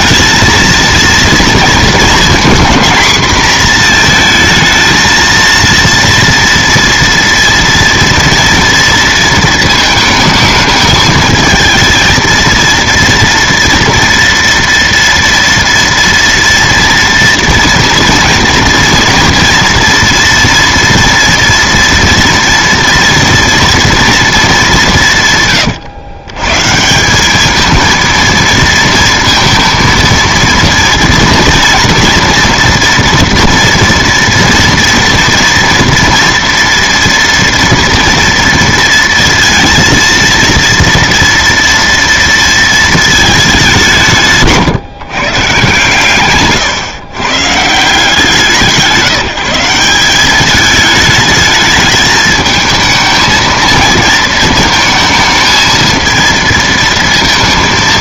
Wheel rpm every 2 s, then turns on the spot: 230, 230, 230, 240, 230, 220, 230, 230, 230, 230, 230, 230, 210, 140, 230, 230, 240, 230, 230, 230, 230, 230, 140, 130, 160, 210, 220, 220, 230.
none